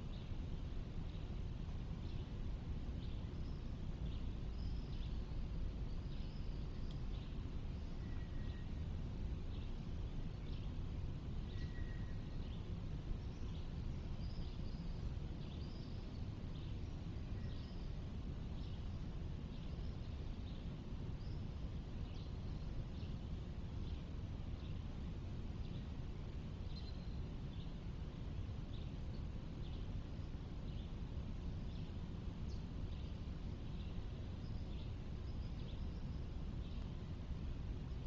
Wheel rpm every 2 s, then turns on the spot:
0, 0, 0, 0, 0, 0, 0, 0, 0, 0, 0, 0, 0, 0, 0, 0, 0, 0, 0.
none